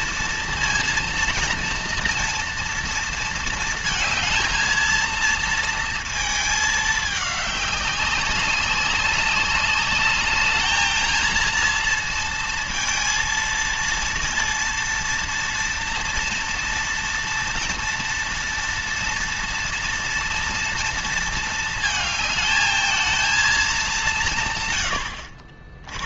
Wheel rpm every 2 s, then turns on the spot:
230, 230, 230, 210, 190, 220, 220, 230, 240, 230, 230, 220, 130.
none